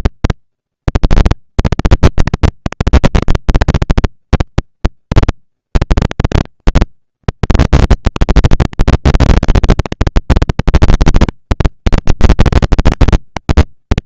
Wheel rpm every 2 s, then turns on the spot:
230, 230, 230, 230, 240, 230, 220.
none